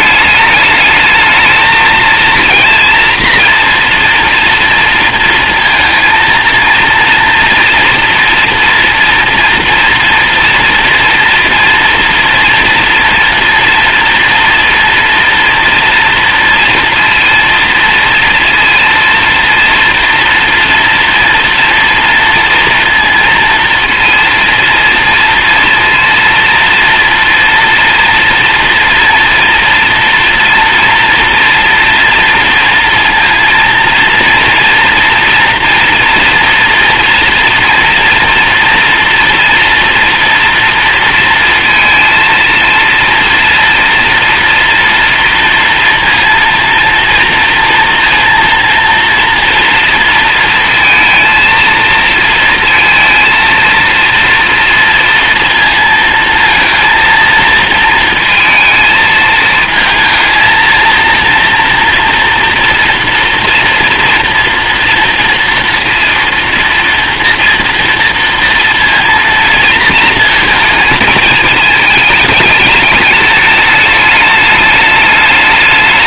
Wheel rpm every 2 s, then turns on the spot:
210, 230, 230, 230, 230, 230, 230, 240, 230, 230, 240, 230, 230, 230, 230, 240, 230, 230, 230, 230, 230, 230, 230, 230, 240, 230, 230, 230, 230, 220, 230, 230, 230, 240, 230, 220, 210, 210.
none